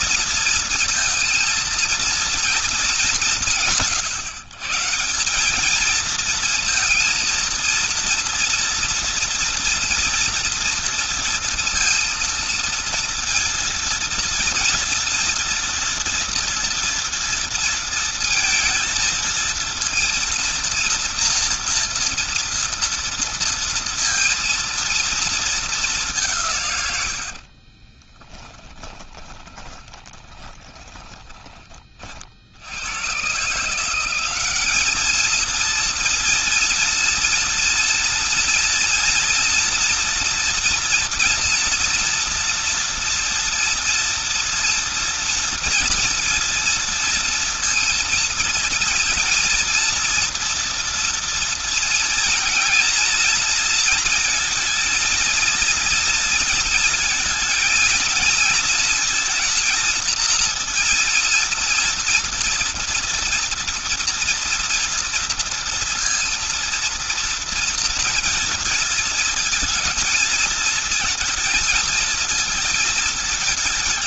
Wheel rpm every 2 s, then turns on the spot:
230, 210, 160, 230, 240, 230, 230, 230, 230, 230, 230, 230, 230, 110, 20, 10, 90, 210, 230, 230, 230, 230, 230, 230, 230, 230, 230, 230, 230, 230, 240, 240, 230, 230, 220, 220, 220.
26-30